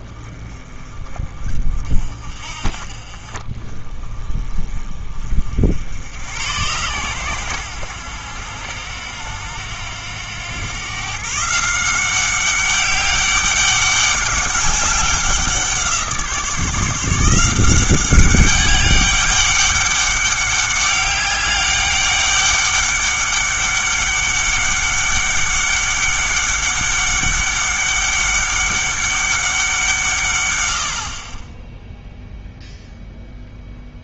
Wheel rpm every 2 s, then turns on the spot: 30, 50, 30, 100, 80, 110, 200, 190, 160, 200, 200, 200, 200, 200, 200, 170, 0.
none